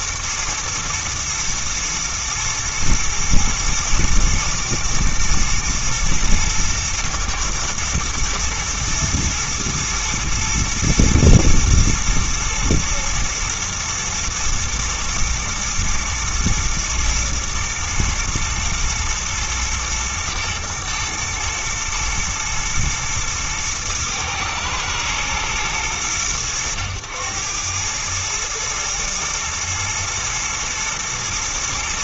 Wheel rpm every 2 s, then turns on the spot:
120, 120, 110, 110, 120, 110, 120, 110, 120, 110, 110, 110, 110, 100, 110, 110.
none